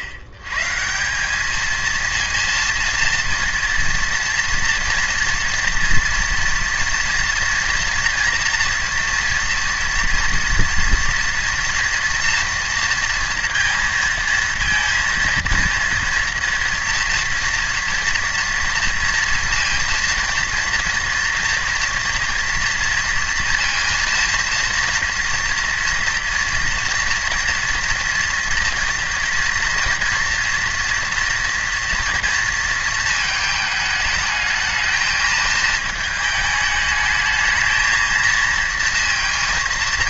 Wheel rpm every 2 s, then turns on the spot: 120, 230, 240, 230, 230, 230, 230, 230, 230, 230, 240, 240, 230, 230, 240, 240, 220, 220, 210, 230.
none